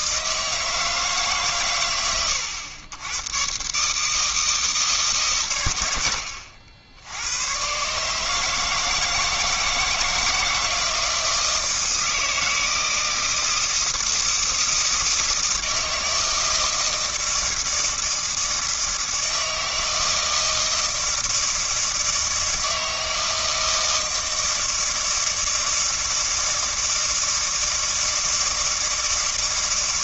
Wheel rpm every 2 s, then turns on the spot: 160, 100, 160, 80, 160, 160, 160, 160, 160, 160, 160, 160, 160, 160, 160.
none